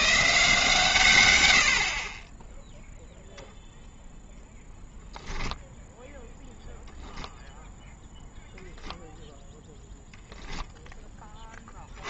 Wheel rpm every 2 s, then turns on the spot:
150, 0, 0, 0, 0, 0.
none